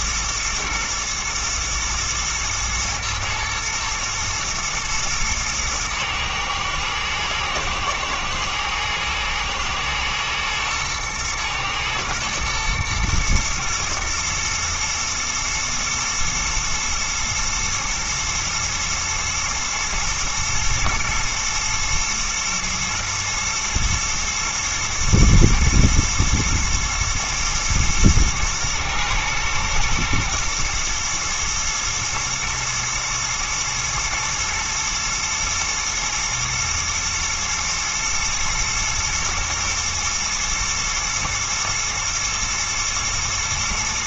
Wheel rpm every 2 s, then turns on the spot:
120, 120, 110, 110, 120, 120, 110, 110, 120, 120, 110, 120, 120, 120, 110, 110, 110, 110, 110, 110, 120, 110.
none